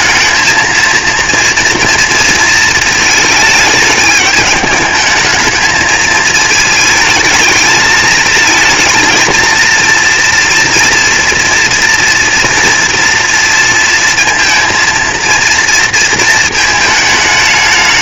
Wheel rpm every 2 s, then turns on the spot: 230, 220, 210, 220, 230, 230, 230, 230, 220.
none